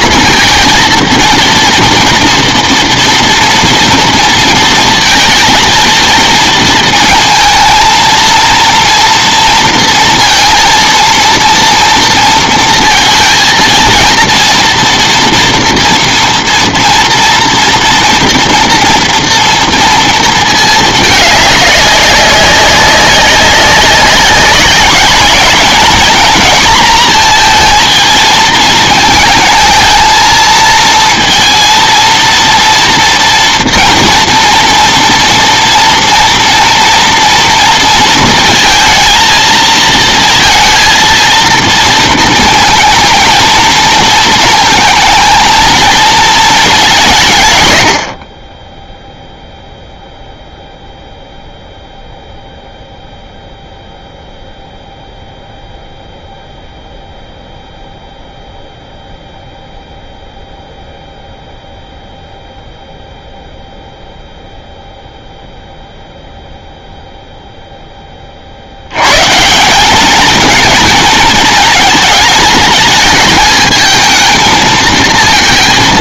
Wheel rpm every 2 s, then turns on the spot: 230, 230, 230, 230, 230, 230, 230, 230, 230, 230, 220, 190, 200, 230, 220, 230, 230, 240, 230, 220, 230, 230, 230, 220, 20, 0, 0, 0, 0, 0, 0, 0, 0, 0, 60, 230, 220, 220.
none